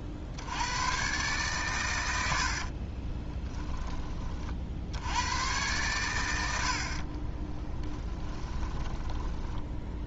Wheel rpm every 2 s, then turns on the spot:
110, 40, 70, 50, 20.
2-4 8-10